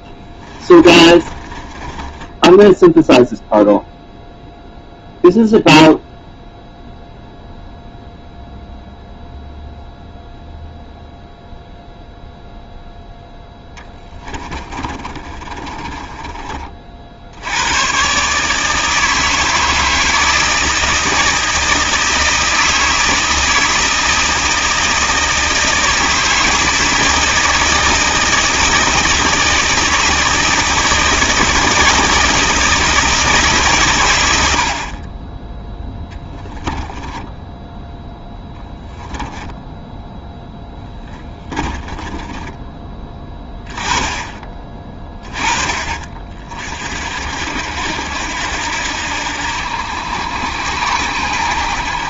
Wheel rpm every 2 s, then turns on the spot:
20, 10, 0, 0, 0, 0, 0, 20, 30, 150, 160, 160, 160, 160, 160, 160, 160, 70, 10, 10, 10, 20, 20, 50, 80, 80.
0-4 14-16 40-44